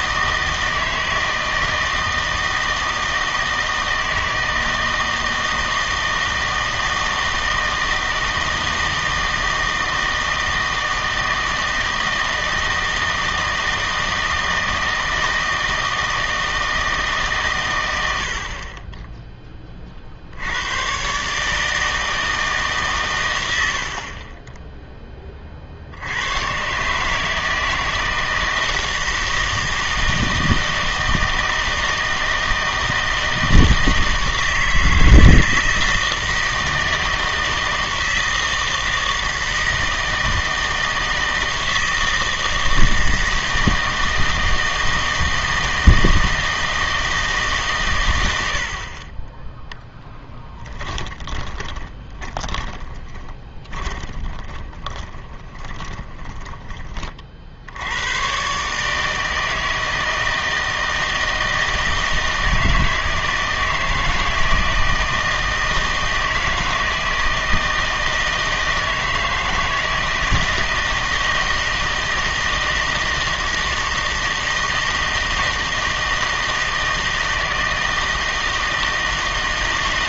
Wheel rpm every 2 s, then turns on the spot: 160, 160, 160, 160, 160, 160, 160, 160, 160, 40, 100, 150, 10, 120, 160, 160, 160, 160, 160, 160, 160, 160, 160, 160, 80, 10, 10, 20, 20, 140, 160, 160, 160, 160, 160, 160, 160, 160, 160, 160.
50-56